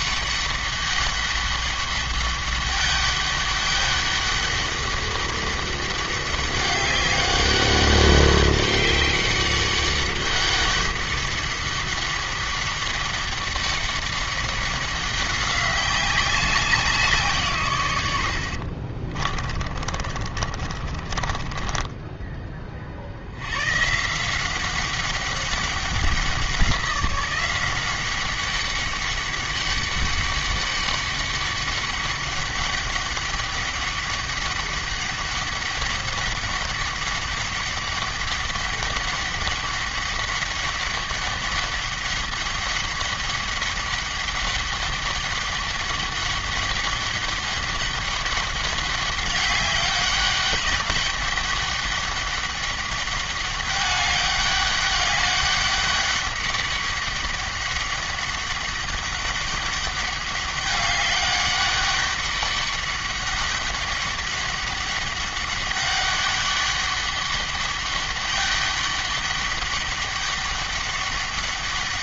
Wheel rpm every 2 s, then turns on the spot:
200, 200, 200, 200, 200, 200, 200, 200, 190, 60, 40, 30, 190, 180, 200, 200, 200, 200, 200, 200, 200, 200, 200, 200, 200, 200, 200, 200, 200, 200, 200, 200, 200, 200, 200, 200.
18-22